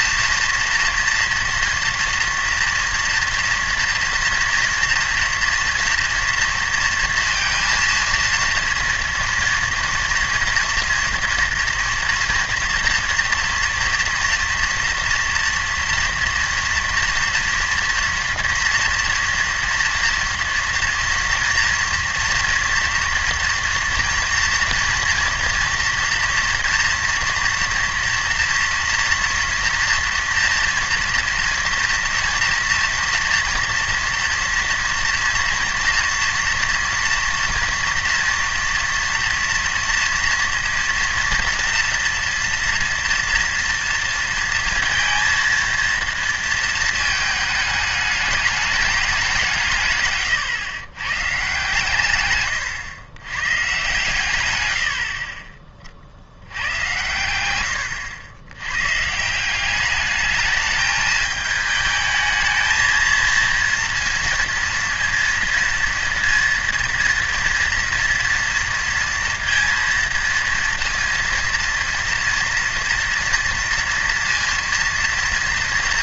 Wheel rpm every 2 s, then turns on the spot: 230, 230, 230, 230, 230, 240, 230, 230, 230, 230, 230, 230, 240, 230, 240, 230, 230, 230, 230, 230, 230, 230, 230, 220, 210, 120, 130, 100, 90, 110, 210, 220, 230, 230, 230, 230, 240, 230.
none